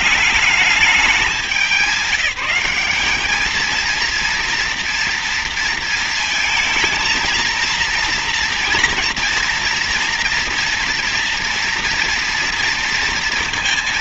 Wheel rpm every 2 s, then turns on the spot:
210, 210, 230, 230, 230, 230, 230.
none